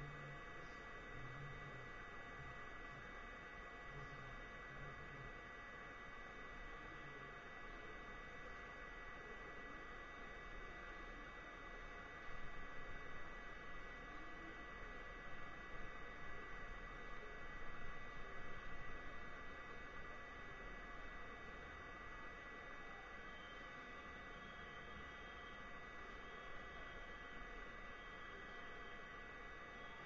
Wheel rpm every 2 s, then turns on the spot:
0, 0, 0, 0, 0, 0, 0, 0, 0, 0, 0, 0, 0, 0, 0.
none